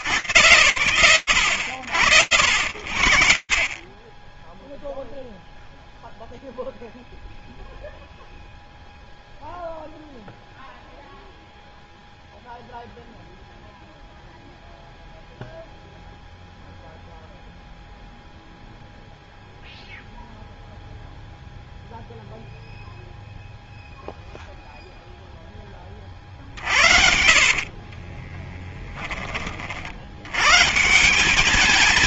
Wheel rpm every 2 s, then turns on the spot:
80, 30, 0, 0, 0, 0, 0, 0, 0, 0, 0, 0, 60, 20, 140, 170.
24-28